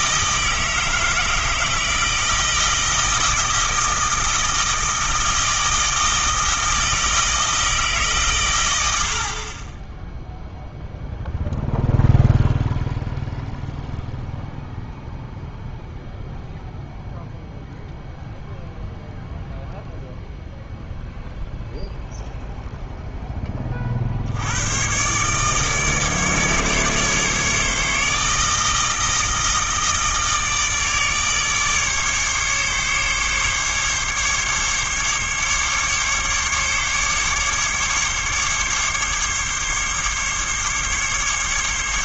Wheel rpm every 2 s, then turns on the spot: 160, 160, 160, 160, 110, 0, 0, 0, 0, 0, 0, 0, 90, 150, 160, 160, 140, 140, 140, 140, 140.
none